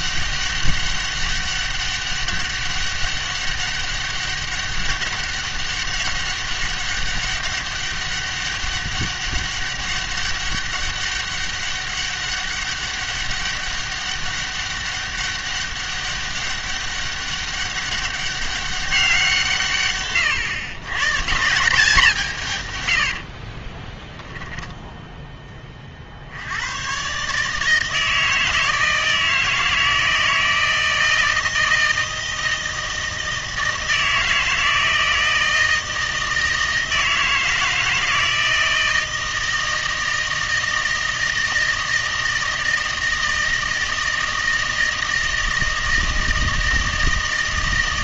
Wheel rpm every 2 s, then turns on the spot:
200, 200, 200, 200, 200, 200, 200, 200, 200, 190, 130, 120, 10, 110, 160, 160, 160, 160, 160, 160, 160, 160, 160, 160.
24-26